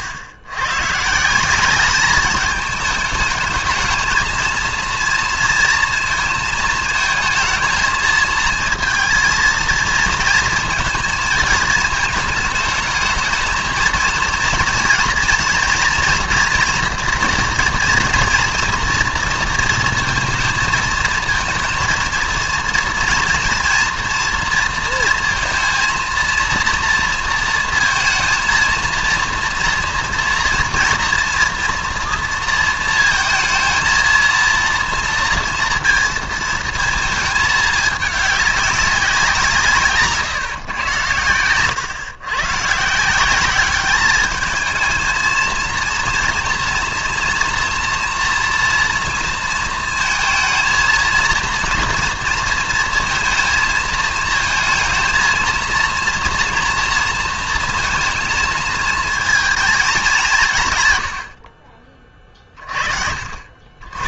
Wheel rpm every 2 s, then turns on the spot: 120, 210, 230, 230, 230, 220, 210, 230, 240, 230, 230, 230, 230, 230, 230, 240, 230, 230, 230, 200, 130, 130, 220, 230, 230, 230, 230, 220, 230, 230, 150, 40.
none